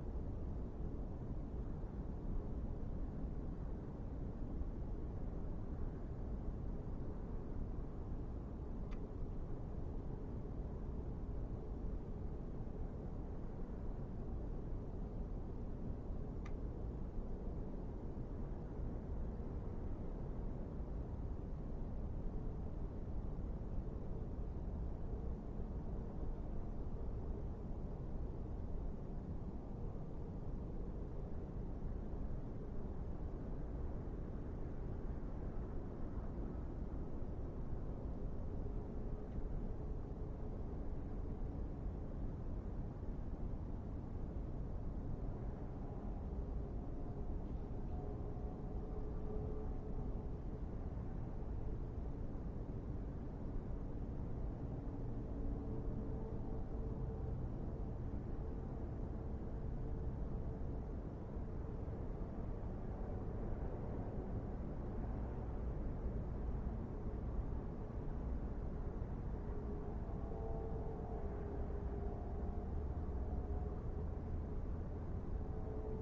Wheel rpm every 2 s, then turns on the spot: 0, 0, 0, 0, 0, 0, 0, 0, 0, 0, 0, 0, 0, 0, 0, 0, 0, 0, 0, 0, 0, 0, 0, 0, 0, 0, 0, 0, 0, 0, 0, 0, 0, 0, 0, 0, 0, 0.
none